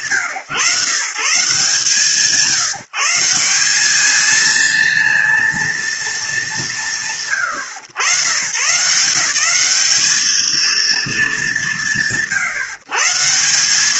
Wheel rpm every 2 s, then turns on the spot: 140, 170, 230, 80, 180, 210, 150.
none